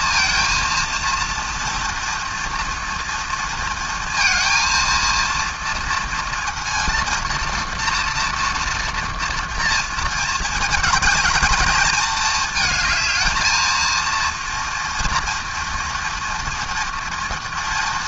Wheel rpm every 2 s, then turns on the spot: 230, 230, 230, 230, 230, 220, 230, 230, 230.
none